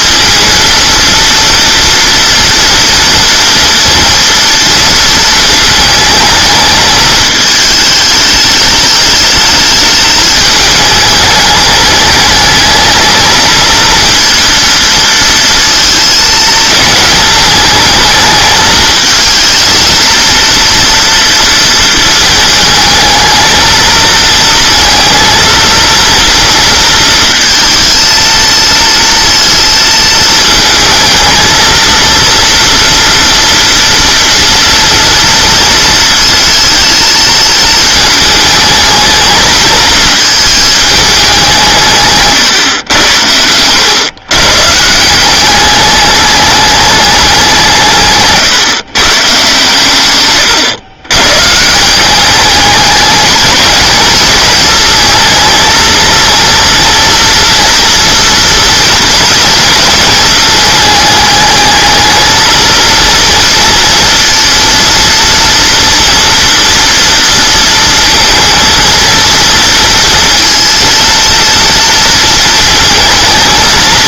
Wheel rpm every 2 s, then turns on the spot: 230, 240, 230, 220, 210, 210, 210, 230, 220, 220, 230, 220, 230, 230, 230, 220, 230, 230, 220, 220, 220, 120, 150, 210, 130, 120, 210, 220, 230, 230, 210, 230, 230, 230, 230, 230, 230.
none